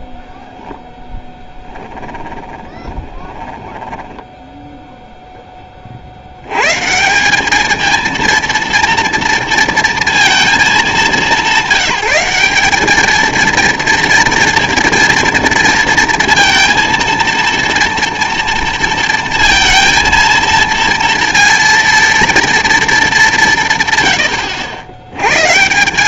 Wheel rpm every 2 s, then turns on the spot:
0, 10, 0, 130, 230, 210, 210, 230, 230, 230, 230, 220, 80.
2-4